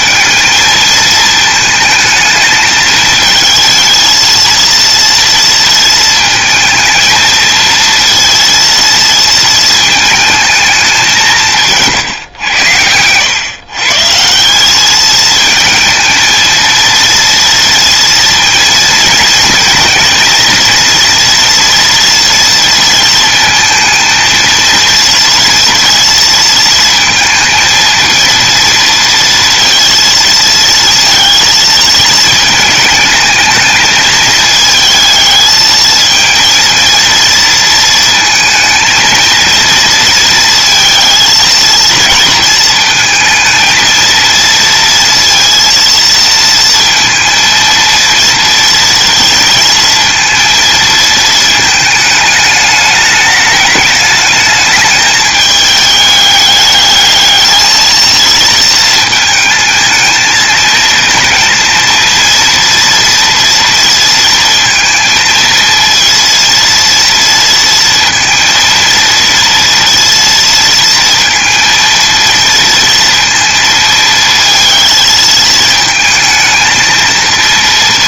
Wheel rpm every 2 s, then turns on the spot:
220, 220, 230, 220, 230, 190, 100, 220, 230, 230, 230, 220, 230, 230, 230, 230, 220, 220, 230, 230, 230, 230, 230, 230, 230, 220, 210, 220, 210, 220, 230, 240, 230, 230, 230, 230, 230, 220, 220.
none